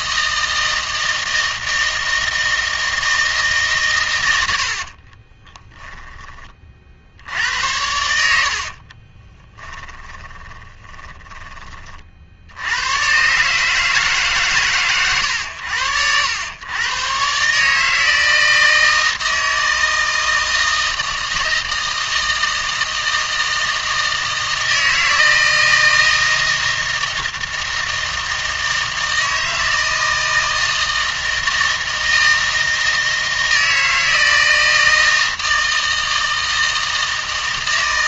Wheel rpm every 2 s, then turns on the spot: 160, 160, 60, 40, 40, 10, 100, 130, 120, 160, 160, 160, 160, 160, 160, 160, 160, 160, 160.
4-6 8-12